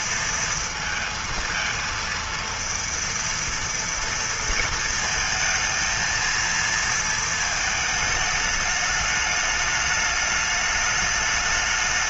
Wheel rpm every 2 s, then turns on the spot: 230, 230, 230, 230, 210, 210.
none